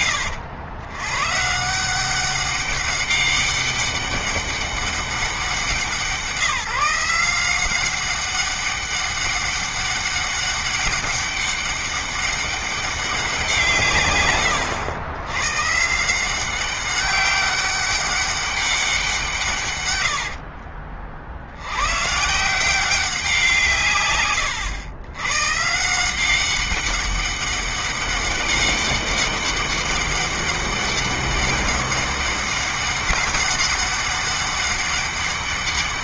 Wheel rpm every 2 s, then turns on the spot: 120, 200, 200, 180, 200, 200, 200, 100, 190, 180, 50, 180, 110, 200, 200, 200, 200, 200.
none